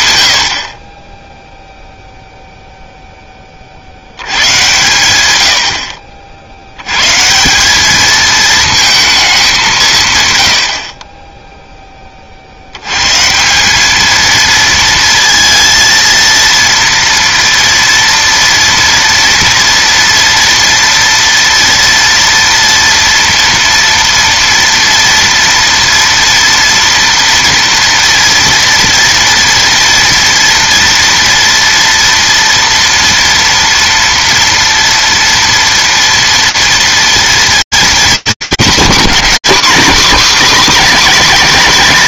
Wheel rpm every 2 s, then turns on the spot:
70, 0, 110, 80, 220, 90, 110, 230, 230, 230, 240, 230, 230, 230, 240, 240, 230, 230, 230, 210, 260.
none